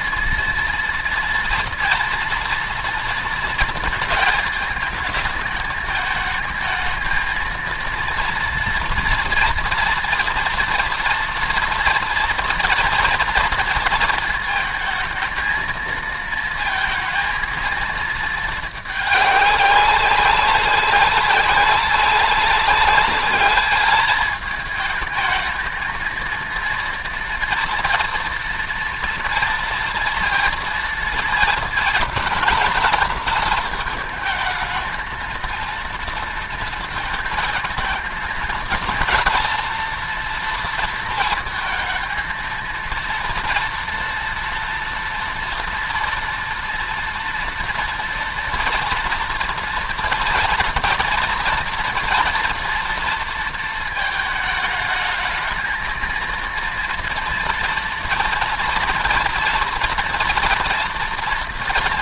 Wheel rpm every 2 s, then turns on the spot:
230, 230, 220, 220, 230, 230, 240, 230, 220, 220, 200, 200, 220, 230, 230, 230, 230, 220, 230, 230, 230, 230, 230, 230, 230, 230, 230, 220, 230, 230, 230.
none